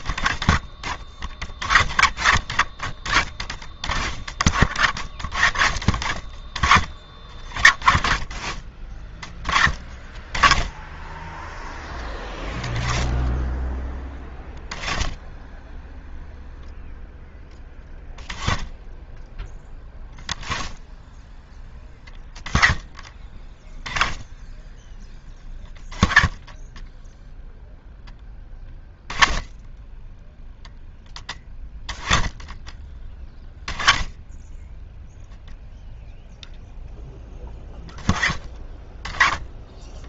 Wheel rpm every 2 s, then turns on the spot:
40, 40, 60, 40, 30, 20, 20, 10, 0, 10, 10, 20, 10, 10, 20, 10, 20, 0, 10, 20.
none